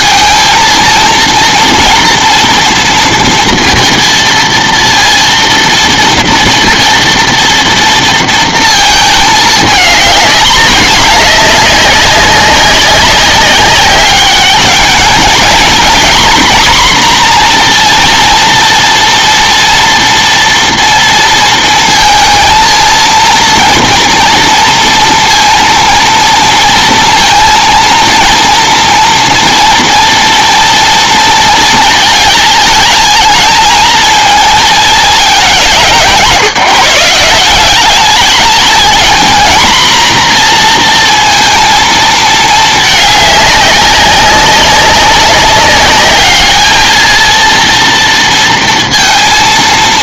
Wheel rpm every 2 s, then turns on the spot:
220, 230, 230, 230, 230, 220, 200, 210, 250, 230, 230, 230, 230, 230, 230, 230, 220, 220, 170, 220, 230, 220, 200, 210, 230.
none